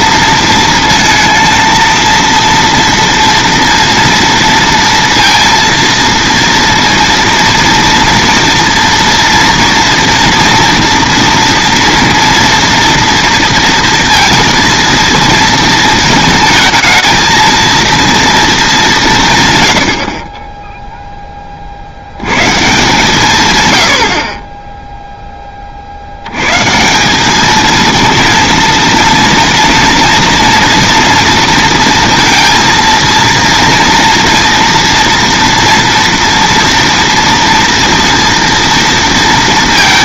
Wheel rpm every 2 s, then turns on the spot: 230, 230, 230, 230, 230, 230, 230, 230, 220, 210, 10, 140, 20, 140, 230, 230, 230, 230, 230, 230.
none